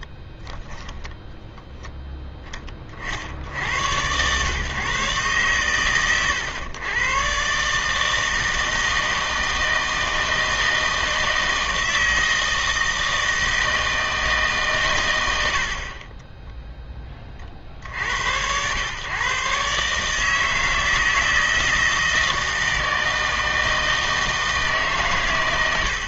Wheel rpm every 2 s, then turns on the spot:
10, 10, 130, 110, 160, 160, 160, 130, 10, 100, 160, 160, 160.
0-2